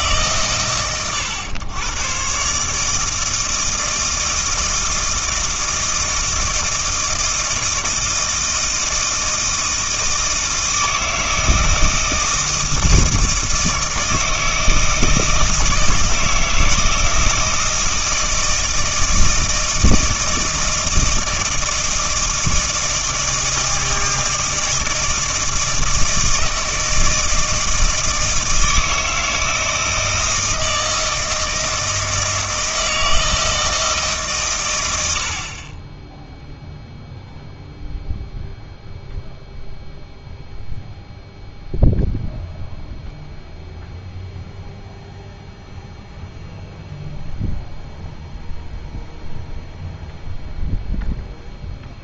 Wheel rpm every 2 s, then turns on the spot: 120, 150, 160, 160, 160, 160, 160, 160, 160, 160, 160, 160, 160, 160, 160, 160, 160, 90, 0, 0, 0, 0, 0, 0, 0, 0.
none